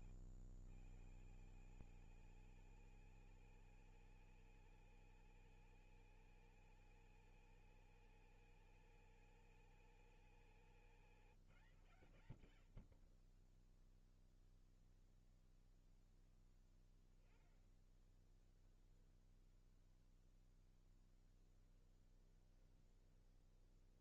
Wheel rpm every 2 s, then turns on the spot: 130, 170, 170, 170, 170, 160, 60, 0, 10, 20, 0, 10.
18-20 22-24